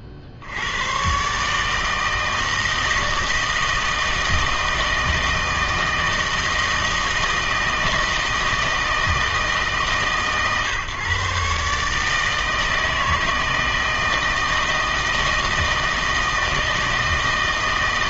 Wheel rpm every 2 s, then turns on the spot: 90, 160, 160, 160, 160, 130, 160, 160, 160.
none